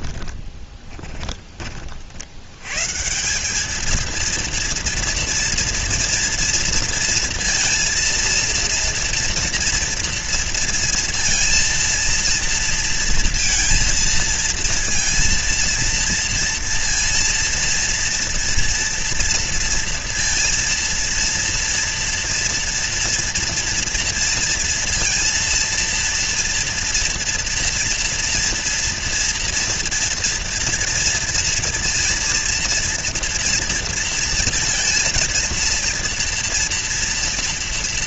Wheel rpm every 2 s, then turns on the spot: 20, 90, 230, 230, 230, 230, 230, 230, 230, 230, 230, 230, 230, 230, 240, 240, 230, 230, 230.
0-2